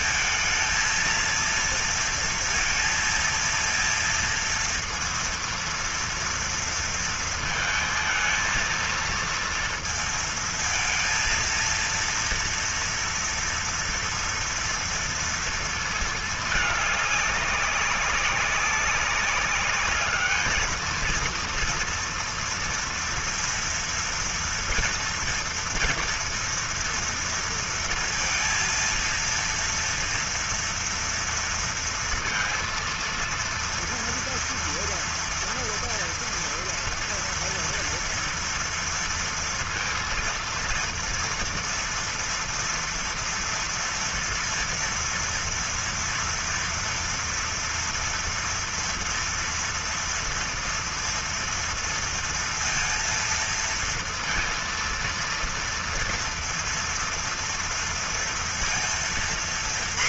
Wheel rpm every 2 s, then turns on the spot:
220, 230, 230, 230, 230, 230, 230, 230, 220, 200, 220, 230, 230, 230, 230, 240, 230, 230, 230, 230, 230, 240, 230, 230, 230, 230, 230, 230, 230, 230.
none